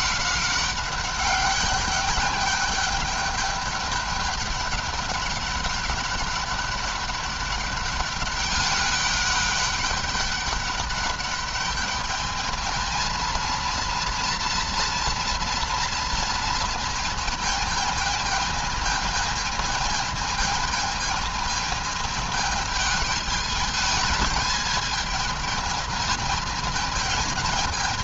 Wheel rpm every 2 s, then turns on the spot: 200, 210, 200, 200, 200, 200, 220, 230, 220, 220, 220, 210, 220, 220.
none